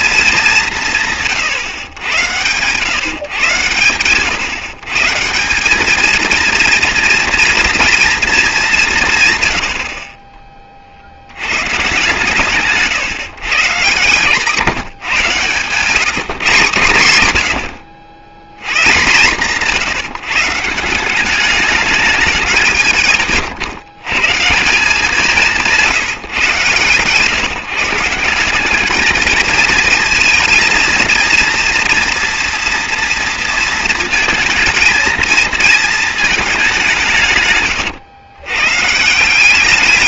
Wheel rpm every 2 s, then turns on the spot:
180, 130, 130, 230, 210, 40, 140, 140, 130, 120, 170, 170, 170, 130, 200, 230, 240, 230, 200, 130.
none